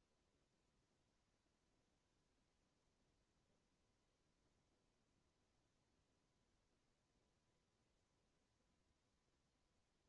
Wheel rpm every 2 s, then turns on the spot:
0, 0, 0, 0, 0.
none